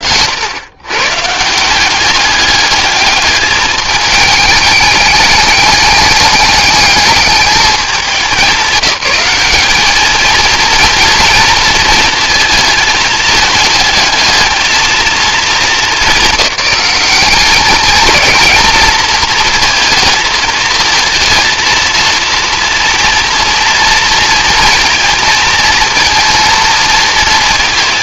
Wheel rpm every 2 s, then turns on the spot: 110, 210, 210, 210, 180, 230, 220, 220, 210, 220, 220, 230, 230, 230.
none